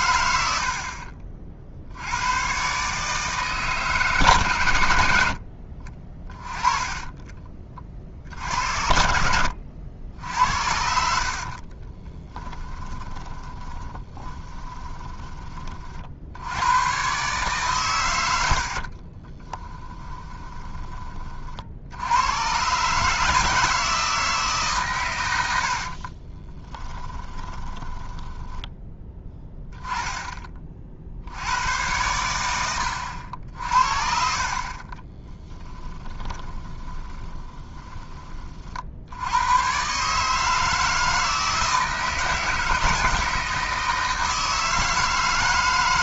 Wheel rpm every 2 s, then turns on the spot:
50, 140, 90, 20, 70, 70, 10, 20, 90, 60, 20, 130, 140, 20, 10, 40, 90, 30, 20, 50, 160, 160, 160.
8-10 12-16 18-20 26-28 36-38